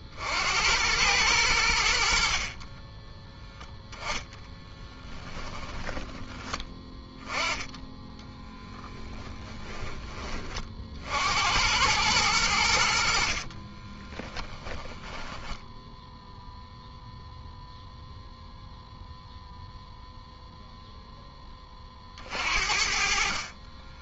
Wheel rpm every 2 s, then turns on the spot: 90, 20, 10, 10, 10, 50, 80, 10, 0, 0, 0, 50.
2-6 8-10 14-16